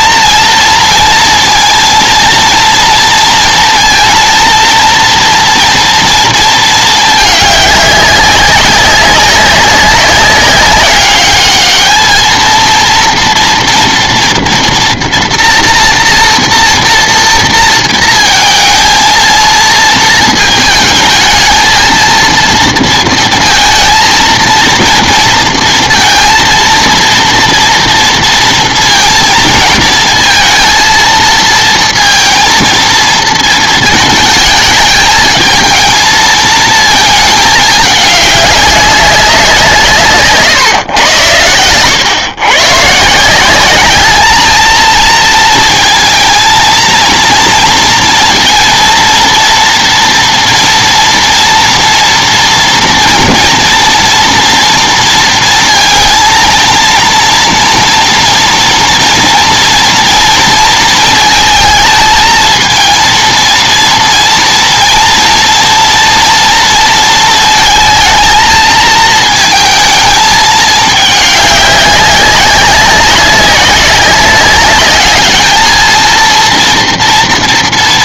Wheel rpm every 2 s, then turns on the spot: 230, 230, 230, 220, 200, 190, 230, 230, 230, 230, 220, 230, 230, 230, 230, 230, 230, 220, 220, 200, 140, 120, 210, 230, 230, 230, 230, 230, 230, 230, 230, 220, 230, 230, 220, 210, 200, 200, 230.
none